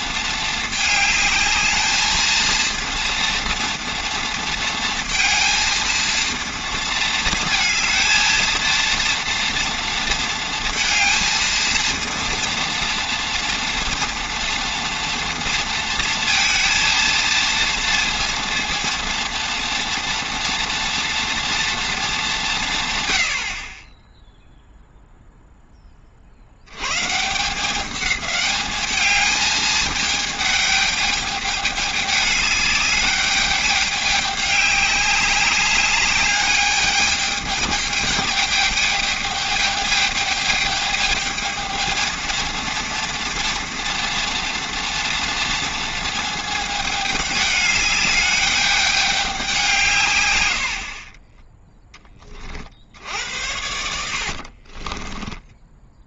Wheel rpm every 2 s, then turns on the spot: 220, 230, 230, 220, 230, 230, 230, 230, 230, 230, 230, 150, 0, 100, 210, 210, 210, 200, 210, 210, 210, 230, 240, 220, 200, 80, 50, 40.
50-52 54-56